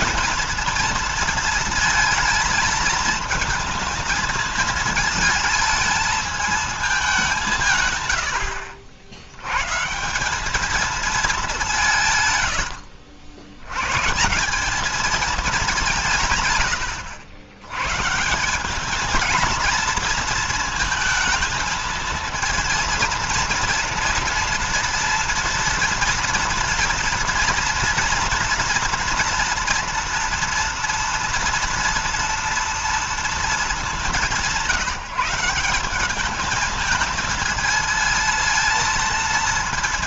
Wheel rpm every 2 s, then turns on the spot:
230, 220, 220, 210, 70, 210, 90, 200, 110, 190, 230, 230, 240, 230, 230, 230, 240, 180, 220, 230.
none